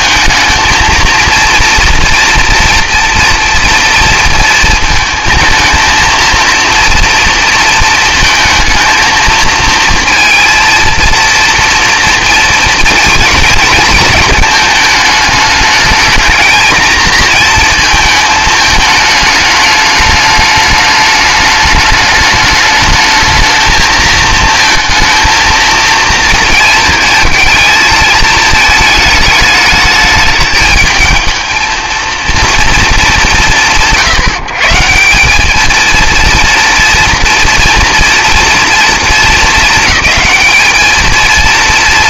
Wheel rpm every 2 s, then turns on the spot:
220, 240, 230, 230, 220, 230, 230, 220, 230, 220, 210, 210, 220, 230, 220, 220, 230, 160, 230, 230, 220.
none